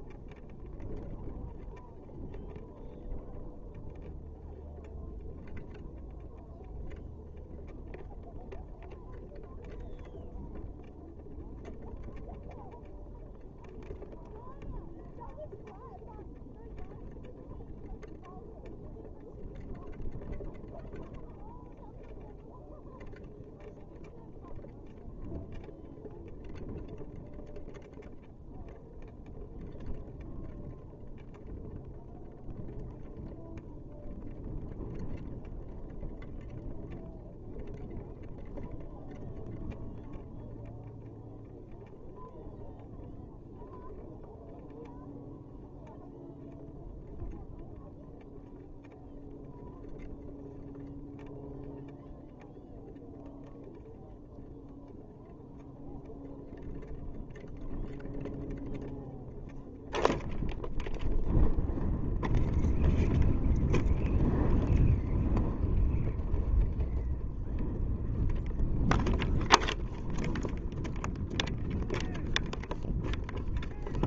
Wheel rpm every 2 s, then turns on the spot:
0, 0, 0, 0, 0, 0, 0, 0, 0, 0, 0, 0, 0, 0, 0, 0, 0, 0, 0, 0, 0, 0, 0, 0, 0, 0, 0, 0, 0, 0, 0, 0, 0, 0, 0, 0, 0.
none